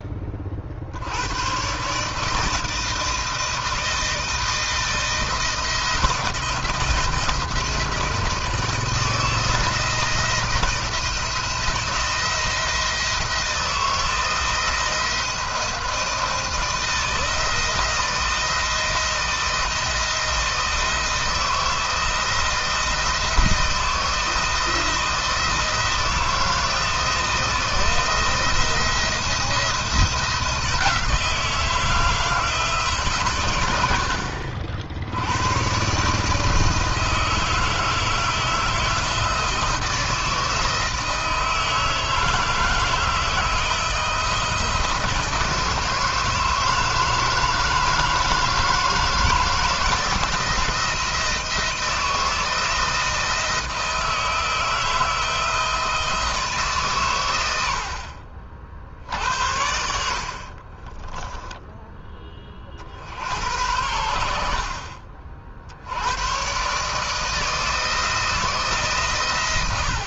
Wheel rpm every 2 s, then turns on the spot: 70, 160, 160, 160, 160, 160, 160, 170, 170, 170, 160, 160, 170, 170, 170, 160, 140, 70, 160, 160, 160, 160, 170, 160, 160, 160, 160, 160, 120, 60, 20, 60, 50, 150, 140.
60-62